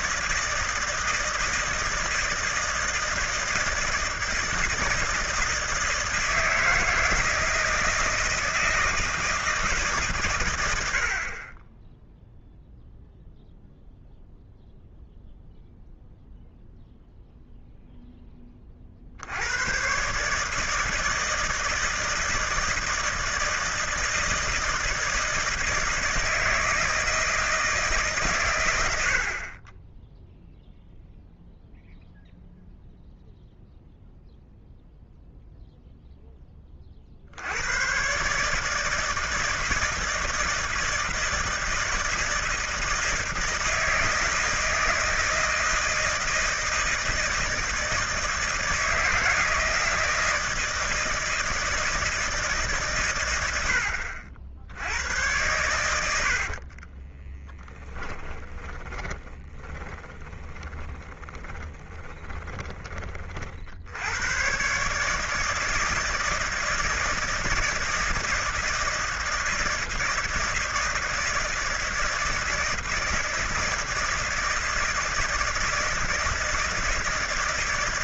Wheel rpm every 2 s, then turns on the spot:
160, 160, 160, 160, 160, 90, 0, 0, 0, 30, 150, 160, 160, 160, 110, 0, 0, 0, 20, 150, 170, 160, 160, 160, 160, 160, 150, 70, 40, 20, 10, 20, 130, 160, 160, 160, 160, 160, 160.
56-62